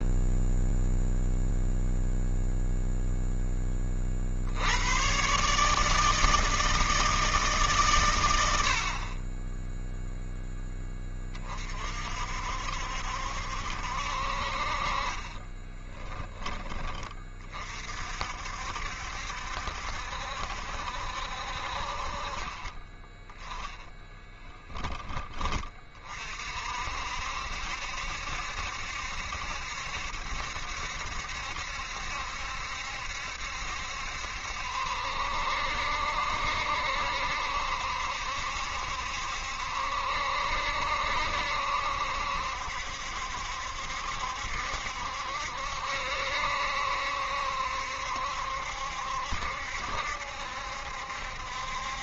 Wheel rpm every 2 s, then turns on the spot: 0, 0, 80, 160, 80, 10, 60, 40, 20, 60, 70, 30, 10, 50, 70, 70, 70, 70, 70, 70, 60, 70, 70, 70, 70, 70.
22-24